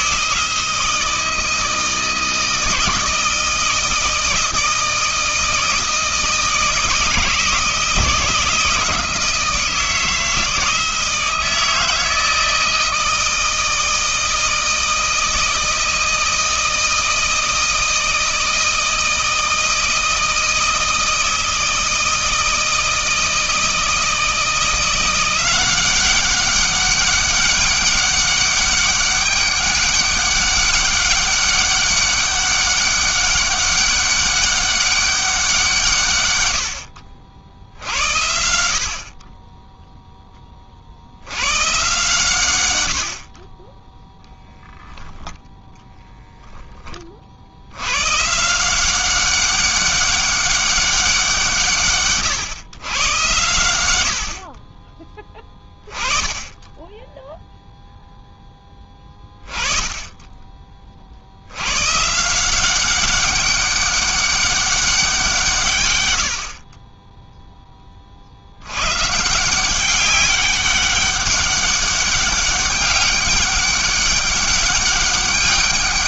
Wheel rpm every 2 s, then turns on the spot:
160, 160, 160, 160, 160, 160, 160, 160, 160, 160, 160, 160, 170, 190, 200, 200, 200, 200, 80, 70, 20, 110, 0, 10, 170, 200, 110, 30, 10, 10, 30, 180, 200, 50, 100, 200, 200, 200.
none